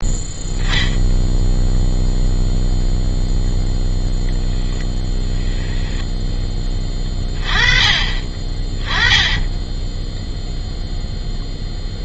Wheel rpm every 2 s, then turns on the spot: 0, 0, 0, 10, 20, 0.
none